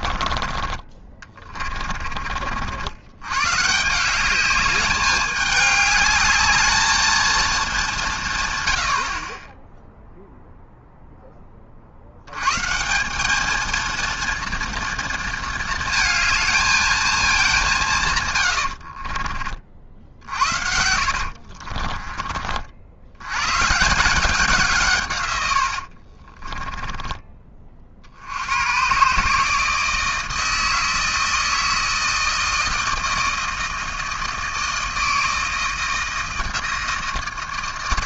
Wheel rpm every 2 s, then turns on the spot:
30, 60, 200, 220, 100, 0, 160, 230, 220, 90, 70, 60, 170, 20, 110, 160, 160, 160, 160.
18-22 26-28